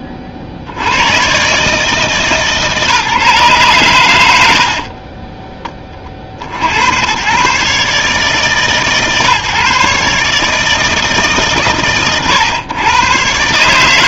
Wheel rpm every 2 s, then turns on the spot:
80, 150, 70, 70, 140, 150, 100.
4-6